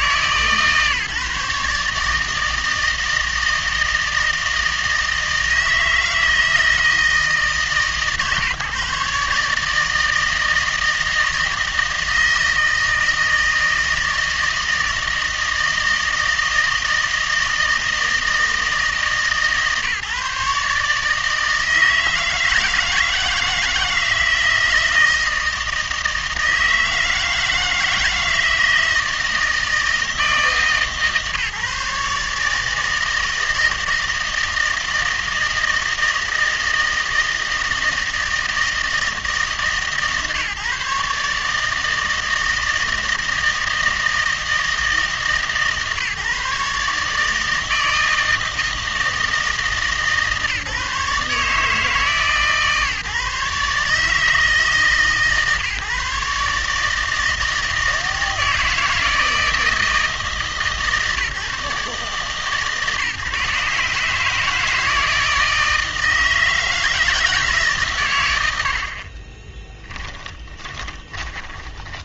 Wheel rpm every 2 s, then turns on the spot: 140, 160, 160, 160, 140, 160, 160, 160, 160, 150, 140, 160, 160, 160, 160, 150, 160, 160, 160, 160, 140, 160, 160, 150, 160, 150, 150, 150, 150, 160, 160, 150, 160, 160, 80, 30.
70-72